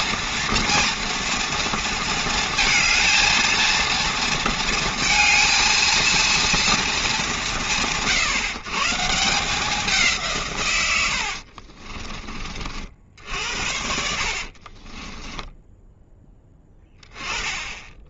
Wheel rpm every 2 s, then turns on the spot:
230, 230, 230, 220, 160, 100, 60, 20, 20.
10-12 14-16